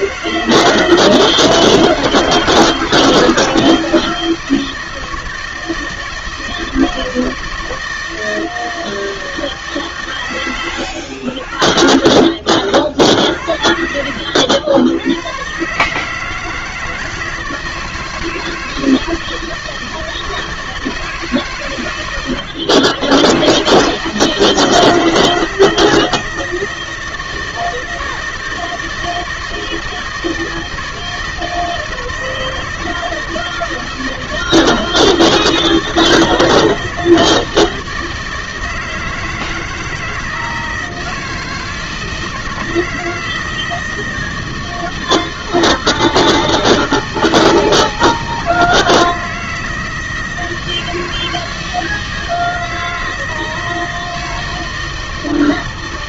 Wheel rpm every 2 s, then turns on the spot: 160, 160, 160, 160, 160, 100, 50, 90, 160, 160, 160, 110, 160, 160, 160, 160, 160, 160, 160, 160, 160, 160, 160, 160, 160, 160, 160, 160.
10-14